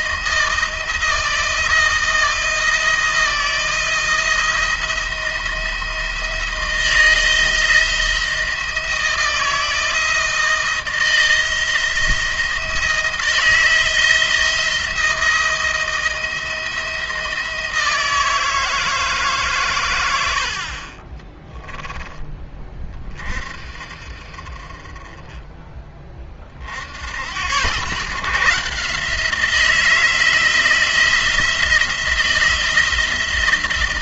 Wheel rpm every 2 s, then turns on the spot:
160, 160, 170, 170, 170, 160, 170, 170, 160, 160, 40, 20, 30, 50, 150, 170, 160.
none